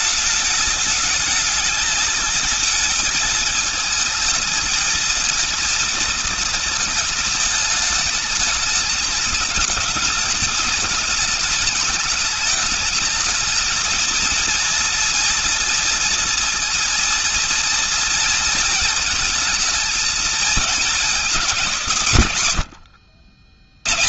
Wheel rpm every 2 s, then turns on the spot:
220, 220, 230, 220, 220, 210, 220, 230, 220, 220, 200, 80.
none